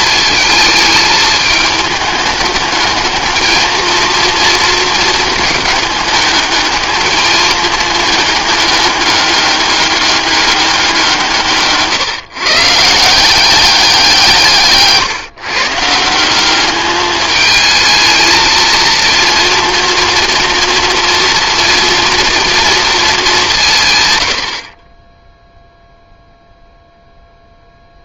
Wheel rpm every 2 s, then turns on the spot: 220, 220, 230, 210, 200, 180, 170, 150, 210, 230, 230, 220, 20, 0.
none